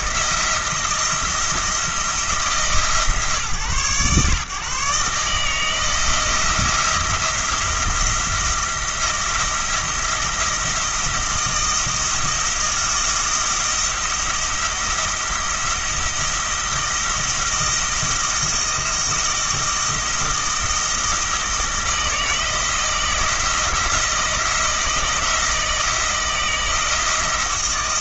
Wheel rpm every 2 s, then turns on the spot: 170, 160, 130, 170, 170, 170, 170, 170, 170, 170, 170, 160, 170, 170.
none